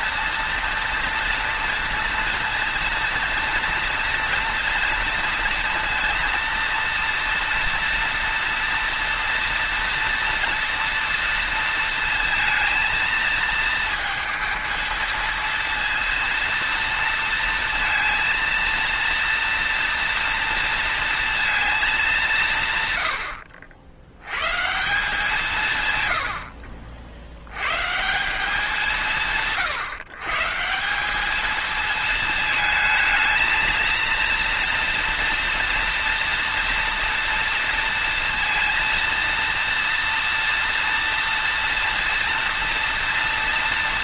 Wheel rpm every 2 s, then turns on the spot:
230, 230, 230, 230, 230, 240, 230, 230, 230, 230, 230, 170, 120, 80, 150, 140, 220, 230, 230, 230, 230, 230.
none